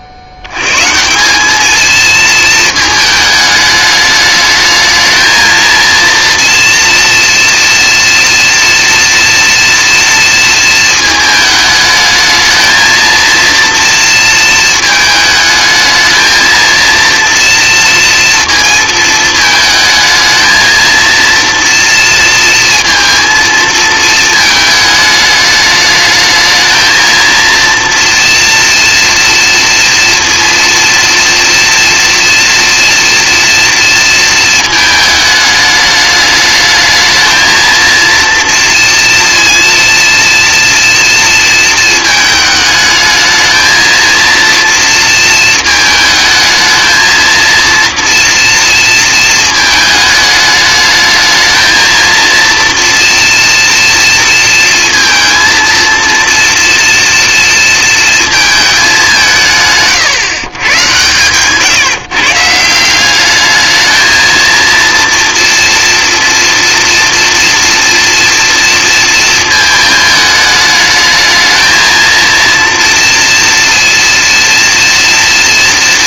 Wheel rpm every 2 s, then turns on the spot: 100, 220, 220, 230, 230, 220, 220, 220, 230, 230, 220, 230, 220, 220, 230, 230, 240, 220, 220, 240, 230, 220, 230, 220, 230, 210, 230, 230, 230, 210, 130, 180, 230, 230, 230, 210, 230, 230.
none